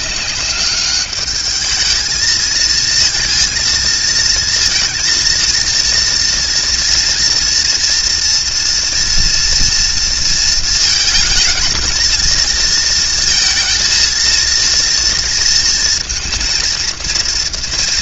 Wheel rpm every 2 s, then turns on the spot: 210, 220, 230, 230, 240, 230, 230, 230, 230.
none